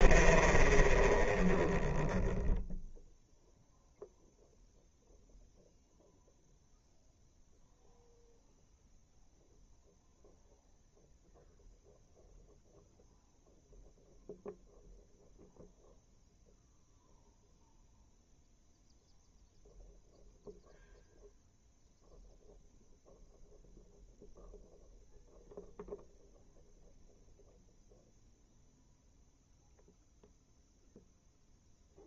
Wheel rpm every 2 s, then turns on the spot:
0, 0, 0, 0, 0, 0, 0, 0, 0, 0, 0, 0, 0, 0, 0, 0.
none